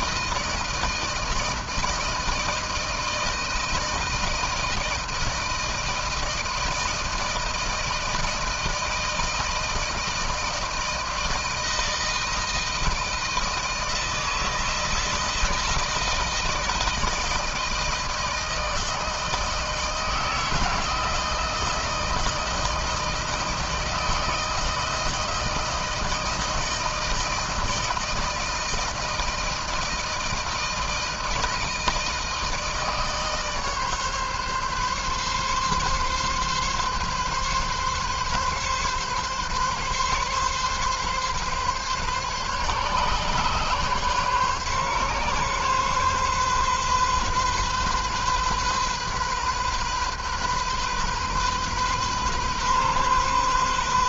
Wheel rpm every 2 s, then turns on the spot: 160, 160, 160, 160, 160, 160, 160, 160, 160, 160, 160, 160, 160, 160, 160, 160, 160, 140, 140, 130, 140, 140, 130, 130, 130, 130, 130.
none